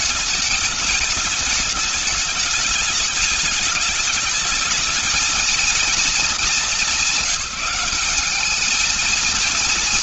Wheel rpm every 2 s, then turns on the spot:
210, 210, 220, 190, 230.
none